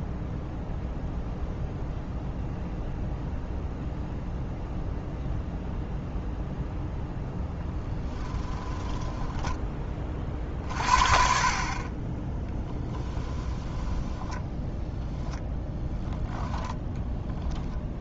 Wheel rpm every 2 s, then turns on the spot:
0, 0, 0, 0, 10, 50, 10, 10, 10.
8-10 12-14 16-18